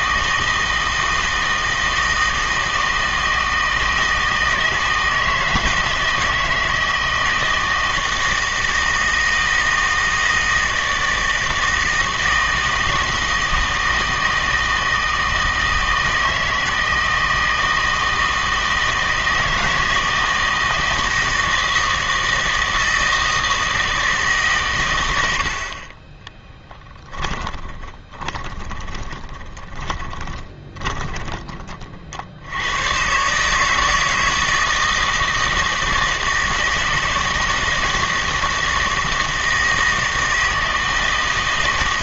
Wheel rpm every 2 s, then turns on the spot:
160, 160, 160, 160, 160, 160, 160, 160, 160, 160, 160, 160, 140, 10, 20, 20, 100, 160, 160, 160, 160.
26-32